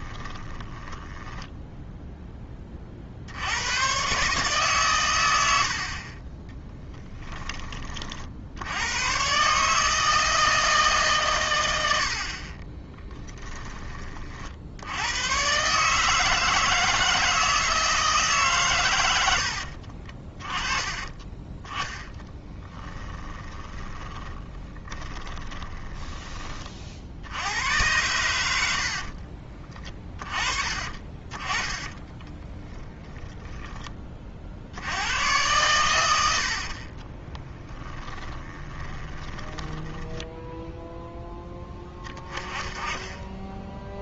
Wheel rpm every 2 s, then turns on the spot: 10, 30, 120, 10, 90, 150, 20, 80, 160, 120, 30, 20, 20, 50, 60, 30, 10, 70, 50, 20, 0, 20.
0-2 6-8 12-14 20-26 28-34 36-40